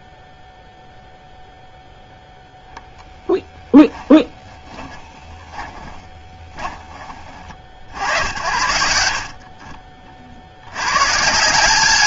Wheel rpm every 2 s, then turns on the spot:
0, 0, 20, 30, 70, 150.
4-6 8-10